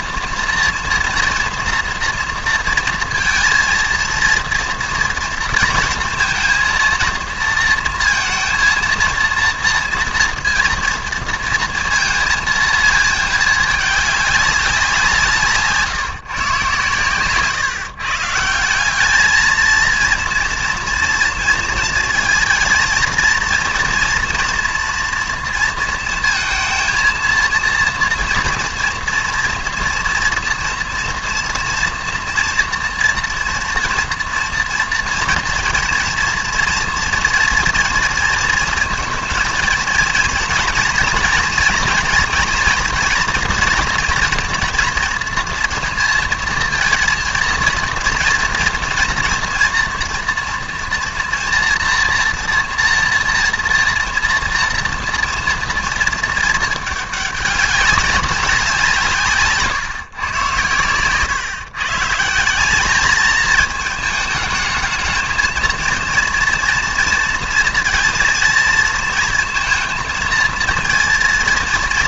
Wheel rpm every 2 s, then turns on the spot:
230, 230, 230, 230, 230, 230, 230, 200, 130, 170, 230, 230, 230, 230, 240, 230, 230, 230, 240, 230, 230, 240, 240, 230, 230, 230, 240, 230, 220, 180, 120, 190, 220, 230, 230, 230.
none